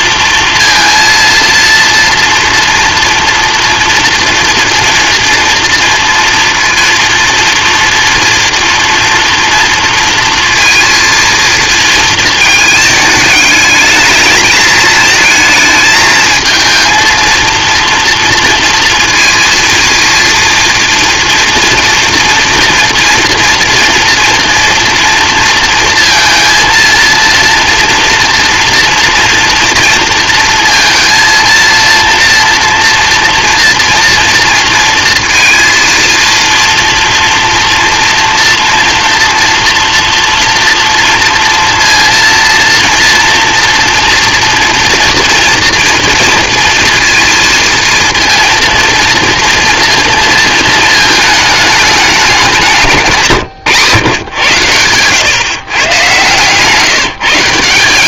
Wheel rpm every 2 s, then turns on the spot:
230, 230, 240, 230, 240, 230, 220, 220, 230, 230, 230, 240, 230, 230, 230, 230, 230, 230, 230, 230, 230, 230, 230, 230, 230, 220, 160, 100, 160.
none